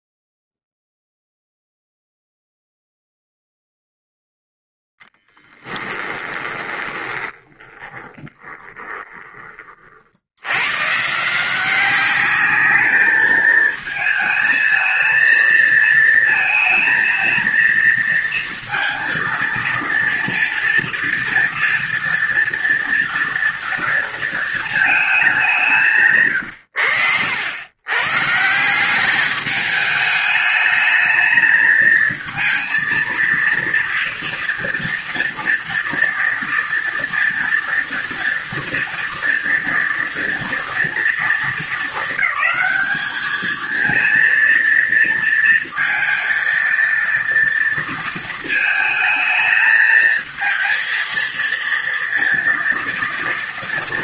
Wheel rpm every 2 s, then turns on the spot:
0, 0, 0, 20, 20, 130, 210, 220, 220, 230, 230, 240, 210, 90, 180, 210, 230, 240, 230, 230, 230, 220, 230, 230, 220, 230, 230.
6-10